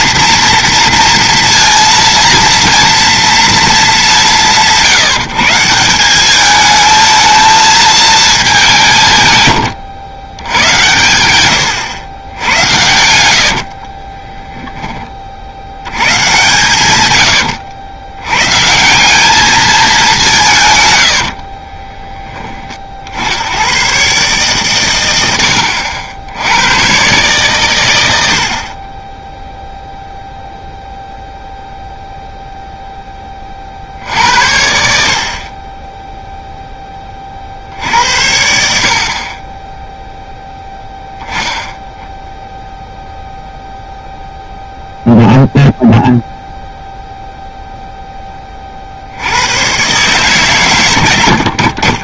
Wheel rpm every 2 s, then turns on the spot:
230, 230, 170, 210, 180, 100, 100, 10, 120, 150, 140, 30, 120, 110, 50, 0, 0, 70, 0, 70, 0, 0, 0, 0, 40, 130.
none